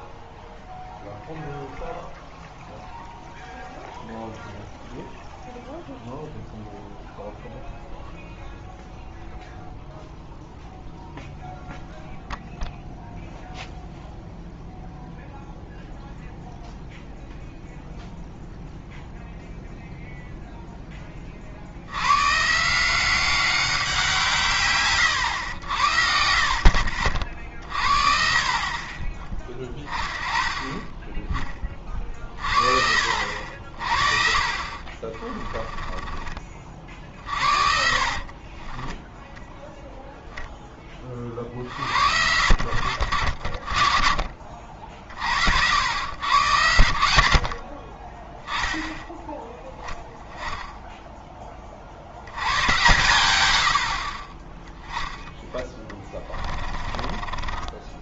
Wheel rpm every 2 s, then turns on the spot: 0, 0, 0, 0, 0, 0, 0, 0, 0, 0, 0, 150, 140, 60, 40, 20, 50, 50, 40, 30, 10, 70, 40, 100, 10, 10, 110, 20, 20.
34-40 56-58